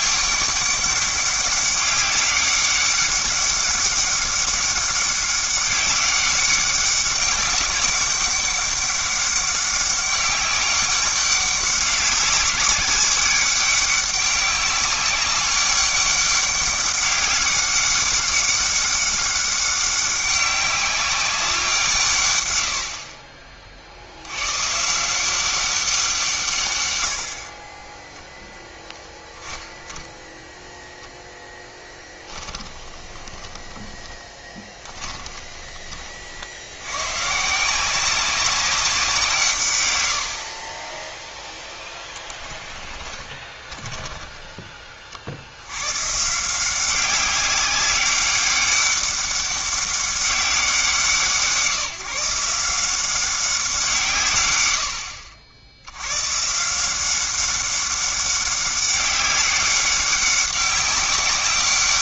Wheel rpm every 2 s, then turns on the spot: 200, 200, 200, 200, 200, 200, 200, 200, 200, 200, 200, 120, 120, 130, 0, 0, 20, 20, 70, 190, 50, 10, 20, 160, 200, 180, 170, 100, 140, 200, 190.
32-36 42-44